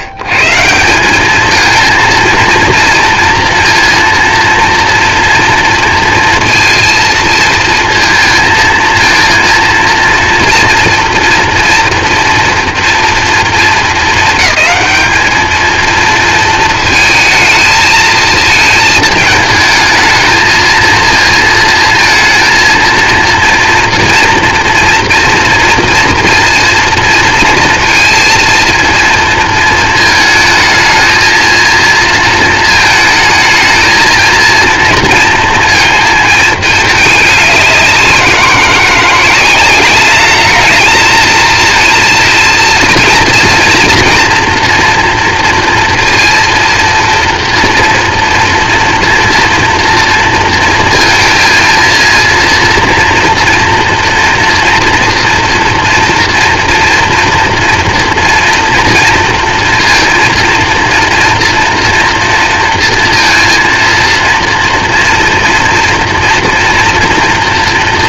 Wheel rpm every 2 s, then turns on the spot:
120, 230, 230, 230, 220, 230, 230, 210, 230, 220, 220, 230, 240, 230, 230, 220, 220, 230, 220, 180, 210, 230, 230, 230, 230, 230, 230, 230, 230, 230, 230, 230, 230, 230.
none